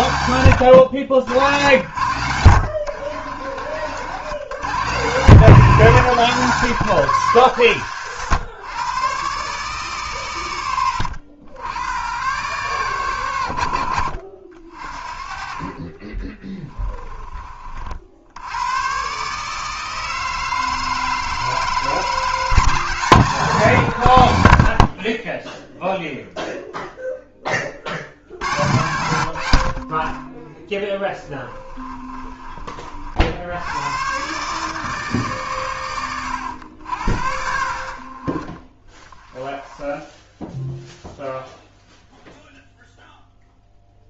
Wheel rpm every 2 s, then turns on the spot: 110, 100, 120, 170, 110, 110, 130, 50, 20, 100, 160, 160, 70, 0, 90, 10, 40, 150, 80, 30, 0, 0.
2-4 16-18